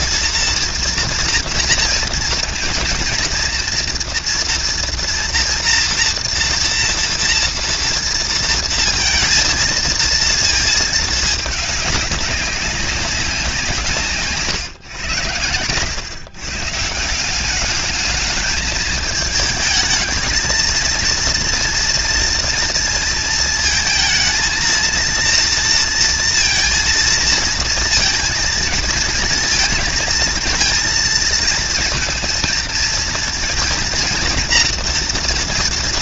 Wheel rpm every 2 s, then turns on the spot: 240, 230, 230, 230, 230, 220, 200, 130, 140, 220, 230, 230, 230, 230, 230, 230, 230, 230.
none